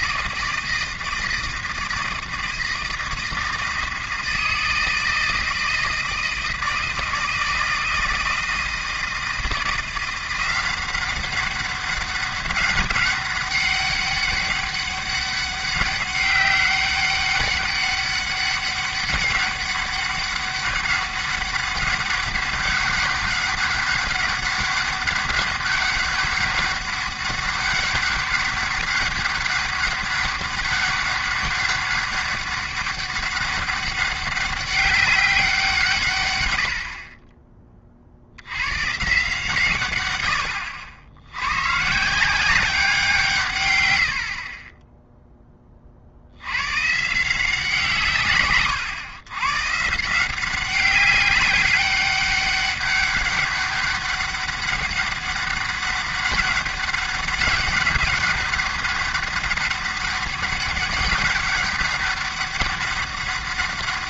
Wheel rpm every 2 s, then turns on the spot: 160, 160, 160, 160, 160, 180, 200, 200, 200, 200, 200, 200, 200, 200, 200, 200, 200, 200, 60, 130, 70, 190, 20, 120, 110, 190, 200, 200, 200, 200, 200, 200.
none